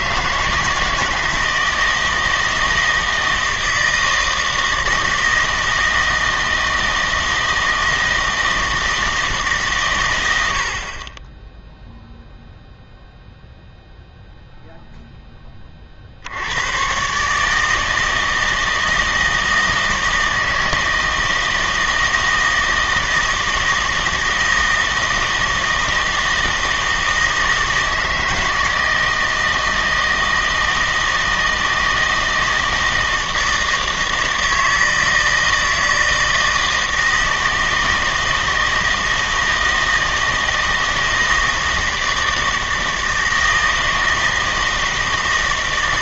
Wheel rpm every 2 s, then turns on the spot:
160, 160, 160, 160, 160, 60, 0, 0, 110, 160, 160, 160, 160, 160, 160, 160, 160, 160, 160, 160, 160, 160, 160.
none